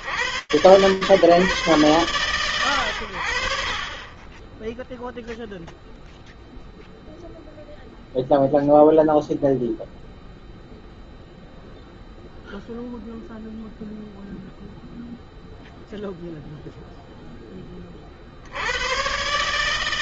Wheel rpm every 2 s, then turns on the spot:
110, 70, 0, 0, 0, 0, 0, 0, 0, 120.
none